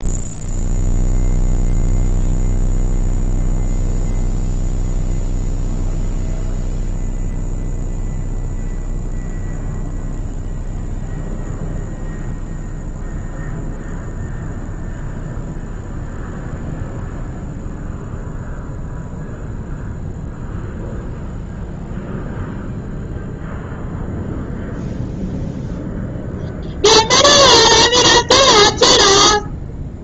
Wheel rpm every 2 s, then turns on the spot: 0, 0, 0, 0, 0, 0, 0, 0, 0, 0, 0, 0, 0, 0, 0.
none